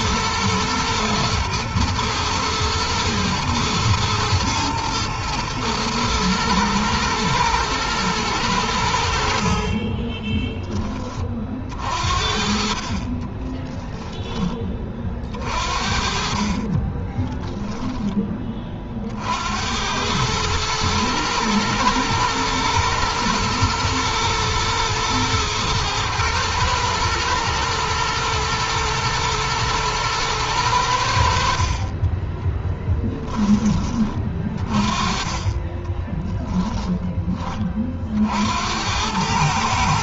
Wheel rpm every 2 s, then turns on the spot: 110, 110, 120, 120, 90, 20, 50, 20, 40, 30, 110, 110, 110, 110, 110, 100, 20, 30, 10, 70.
16-18 32-34 36-38